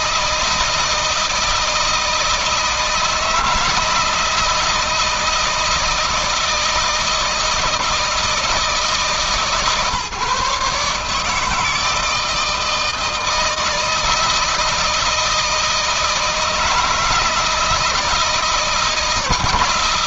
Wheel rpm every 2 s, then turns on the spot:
160, 160, 160, 160, 160, 150, 160, 160, 160, 160.
none